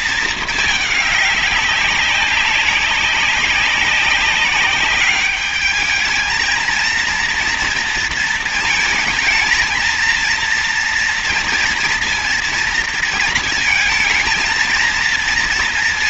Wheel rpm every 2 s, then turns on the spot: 210, 190, 200, 230, 220, 230, 230, 230.
none